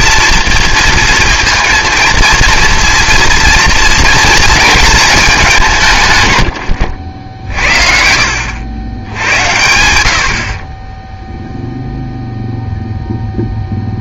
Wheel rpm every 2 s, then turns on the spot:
230, 230, 220, 90, 80, 20, 0.
6-8